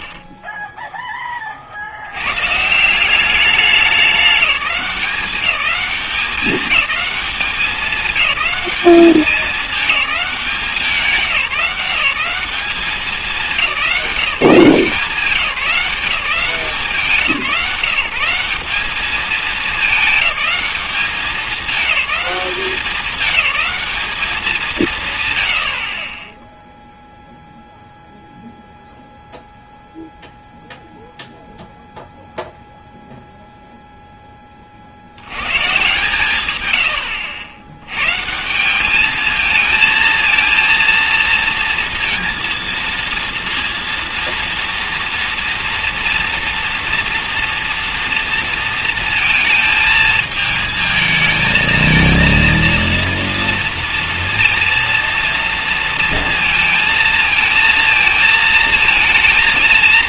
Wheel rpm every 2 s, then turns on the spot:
0, 140, 200, 210, 200, 180, 180, 180, 170, 200, 210, 200, 190, 0, 0, 0, 0, 30, 110, 180, 230, 230, 230, 230, 230, 220, 230, 230, 230, 230.
none